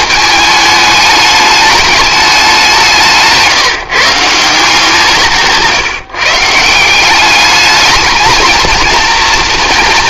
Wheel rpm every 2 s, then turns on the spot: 220, 190, 160, 170, 230.
none